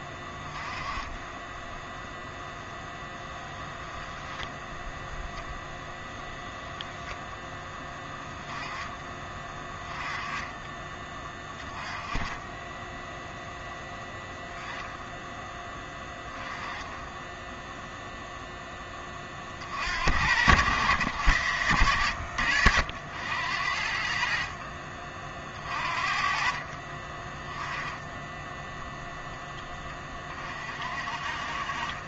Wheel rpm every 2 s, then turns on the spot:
10, 0, 0, 0, 10, 20, 10, 10, 10, 10, 100, 70, 40, 40, 0, 40.
none